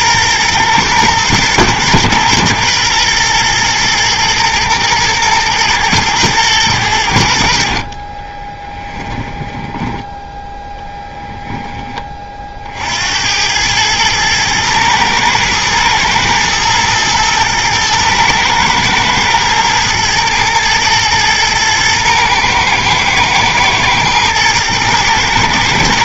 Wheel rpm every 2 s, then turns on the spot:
120, 120, 120, 100, 20, 0, 50, 110, 120, 110, 110, 110, 110.
8-10